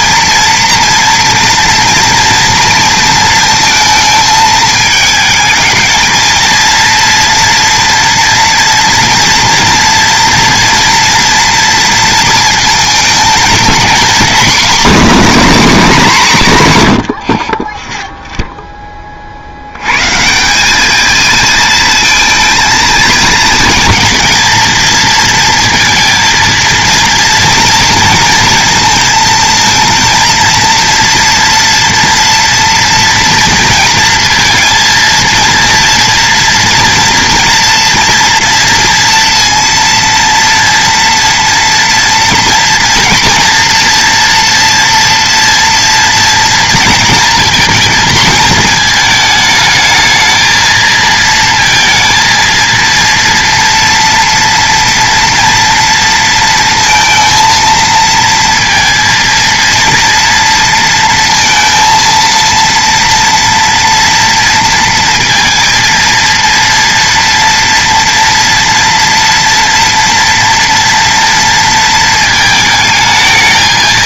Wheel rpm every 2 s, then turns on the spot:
230, 230, 220, 230, 240, 230, 220, 240, 160, 10, 190, 230, 230, 230, 230, 230, 230, 230, 230, 230, 230, 230, 230, 230, 220, 230, 230, 230, 230, 230, 230, 230, 230, 230, 230, 230, 220.
none